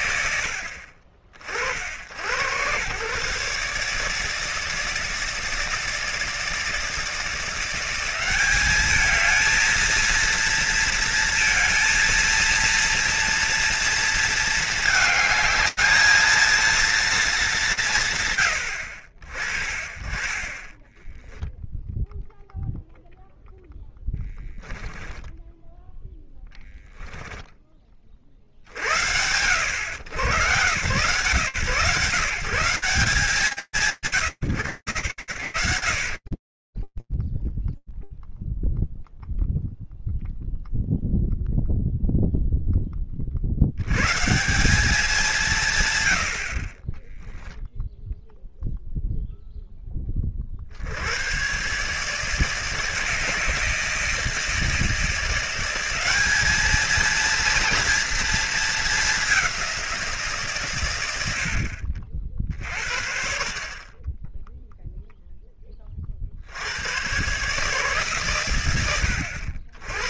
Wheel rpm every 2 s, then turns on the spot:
70, 120, 160, 160, 200, 230, 230, 220, 220, 120, 20, 0, 10, 10, 50, 110, 150, 90, 10, 0, 0, 0, 140, 110, 0, 30, 150, 160, 210, 230, 140, 40, 0, 110, 100.
24-28